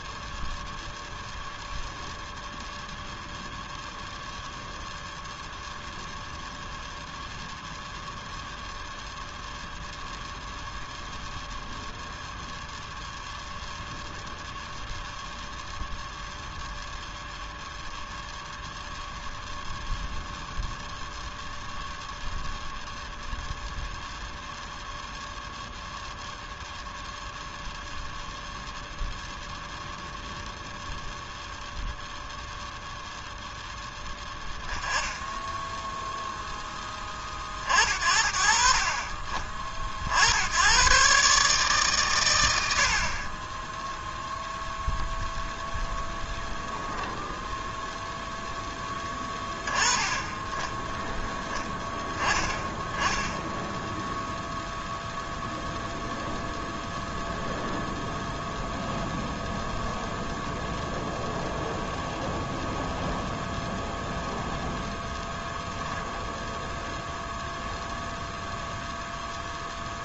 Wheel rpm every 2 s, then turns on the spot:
0, 0, 0, 0, 0, 0, 0, 0, 0, 0, 0, 0, 0, 0, 0, 0, 0, 10, 20, 40, 120, 60, 0, 0, 20, 10, 10, 0, 0, 0, 0, 0, 0, 0, 0.
none